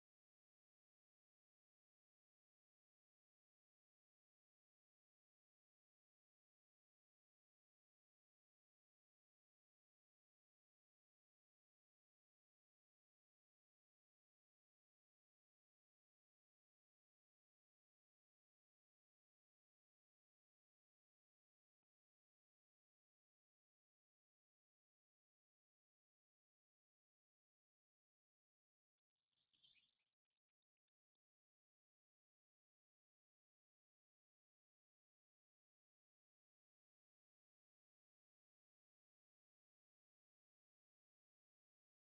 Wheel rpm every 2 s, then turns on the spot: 0, 0, 0, 0, 0, 0, 0, 0, 0, 0, 0, 0, 0, 0, 0, 0, 0, 0, 0, 0, 0.
none